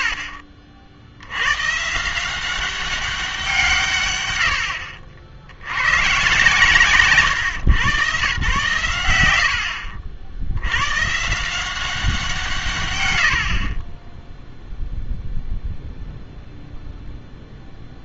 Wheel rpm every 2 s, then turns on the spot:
80, 190, 90, 140, 110, 90, 140, 0, 0.
0-2